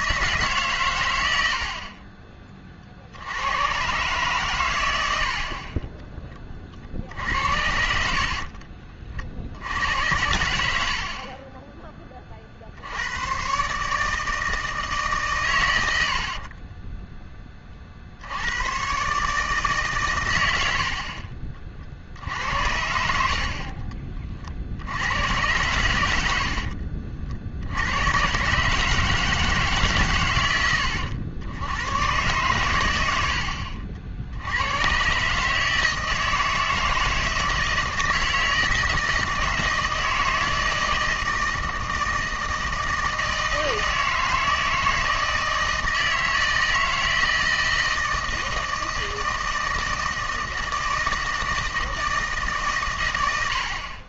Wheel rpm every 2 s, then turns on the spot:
140, 40, 110, 40, 50, 80, 60, 160, 50, 100, 90, 70, 60, 70, 140, 100, 120, 90, 160, 160, 160, 160, 160, 160, 160, 160, 140.
8-10 16-18 26-28